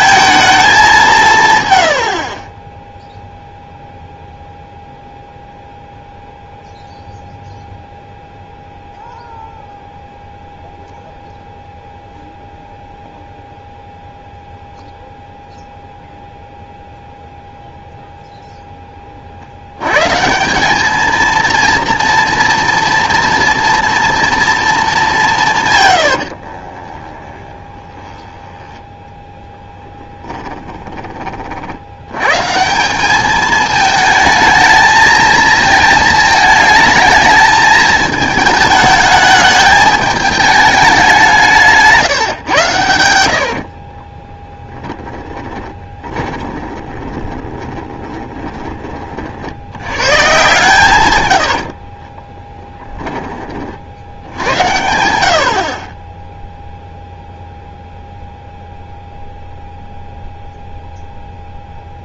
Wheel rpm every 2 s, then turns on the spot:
210, 10, 0, 0, 0, 0, 0, 0, 0, 10, 190, 230, 220, 40, 10, 20, 150, 220, 220, 220, 200, 110, 10, 20, 30, 140, 10, 90, 0, 0, 0.
26-32 44-48